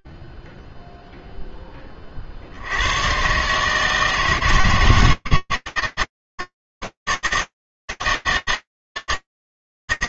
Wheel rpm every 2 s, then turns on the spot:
0, 70, 160, 150, 160.
none